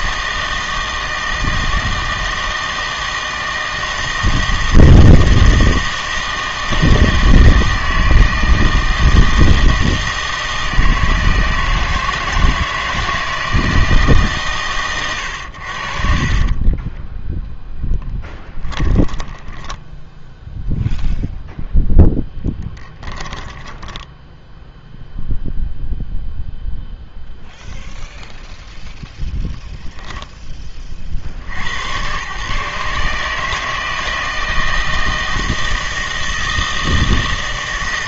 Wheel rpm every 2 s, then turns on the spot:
160, 160, 160, 160, 160, 160, 160, 130, 20, 10, 0, 10, 0, 0, 0, 30, 150, 160, 160.
16-20 22-24